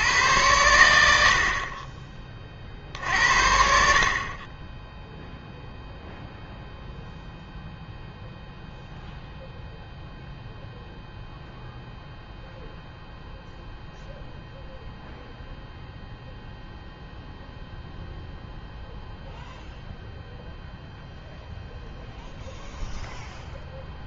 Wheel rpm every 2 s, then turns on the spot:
90, 50, 10, 0, 0, 0, 0, 0, 0, 0, 0, 0.
none